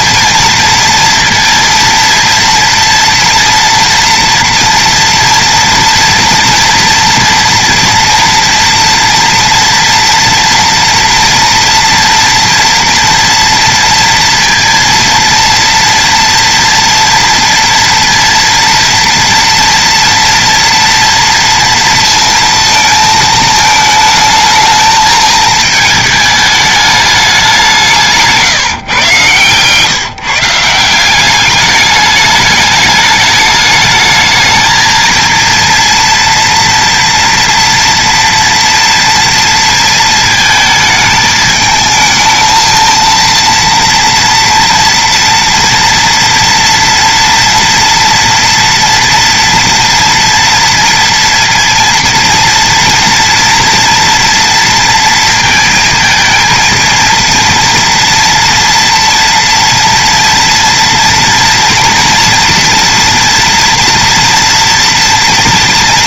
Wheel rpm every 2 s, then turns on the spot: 230, 230, 230, 230, 230, 230, 230, 230, 230, 230, 230, 230, 220, 210, 170, 150, 210, 220, 240, 230, 220, 220, 230, 230, 230, 230, 230, 230, 220, 230, 230, 230, 230.
28-30